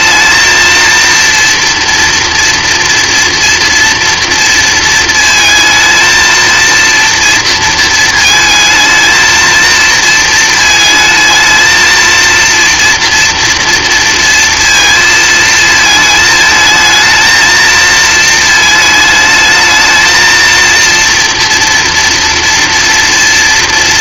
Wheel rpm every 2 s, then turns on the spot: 230, 230, 230, 230, 220, 220, 230, 230, 220, 220, 230, 230.
none